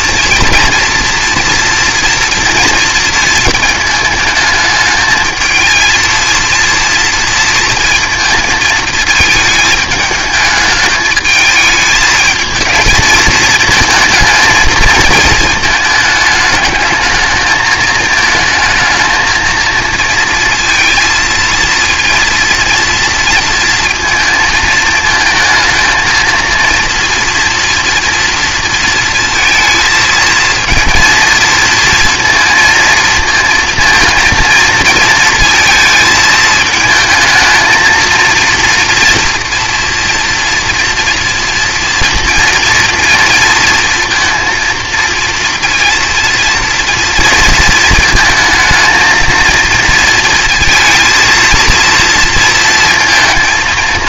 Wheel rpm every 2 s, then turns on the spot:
230, 230, 220, 230, 220, 220, 220, 220, 210, 220, 230, 230, 220, 230, 230, 230, 230, 220, 220, 230, 230, 230, 230, 230, 220, 230, 230.
none